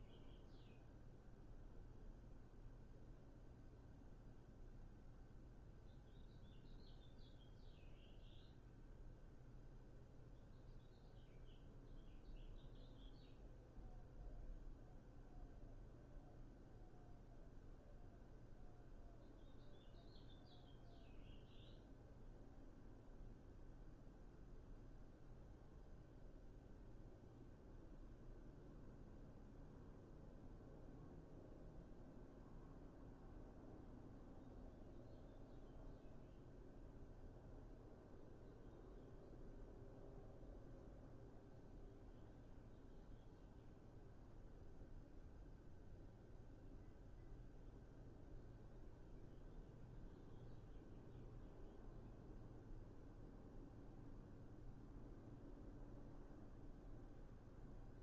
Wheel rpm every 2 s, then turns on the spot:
0, 0, 0, 0, 0, 0, 0, 0, 0, 0, 0, 0, 0, 0, 0, 0, 0, 0, 0, 0, 0, 0, 0, 0, 0, 0, 0, 0, 0.
none